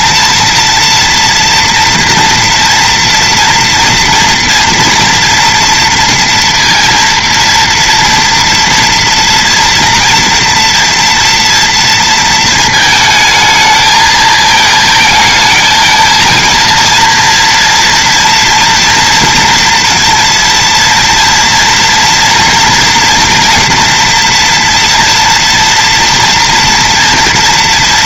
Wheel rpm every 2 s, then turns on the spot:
230, 230, 230, 230, 230, 230, 220, 220, 230, 230, 230, 230, 240, 230.
none